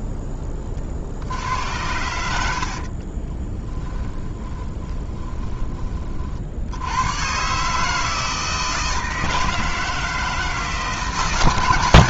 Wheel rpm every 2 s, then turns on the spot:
30, 50, 30, 90, 160, 160.
2-6